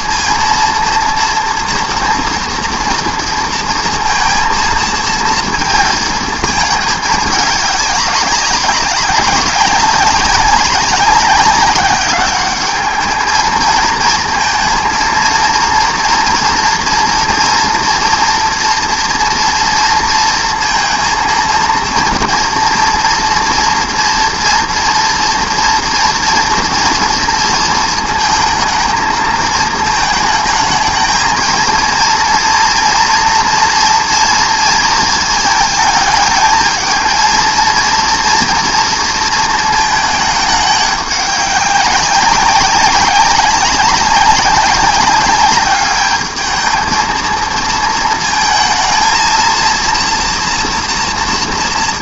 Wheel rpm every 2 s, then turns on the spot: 230, 230, 230, 220, 200, 200, 200, 230, 230, 230, 230, 230, 230, 230, 220, 220, 230, 230, 220, 230, 210, 190, 200, 220, 230, 230.
none